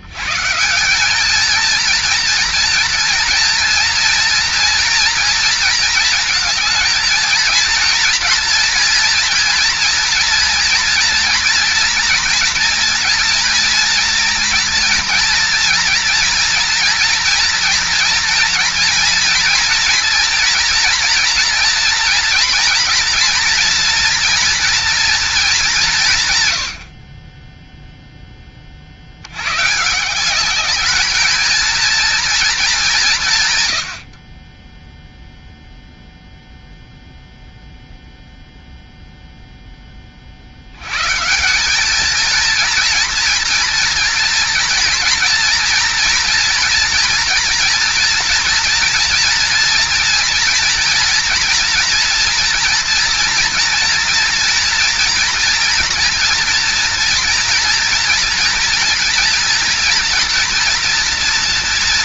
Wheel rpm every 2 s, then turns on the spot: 160, 240, 240, 220, 230, 230, 230, 230, 230, 240, 240, 230, 230, 110, 30, 210, 210, 20, 0, 0, 70, 230, 230, 240, 240, 240, 230, 230, 230, 230, 230.
none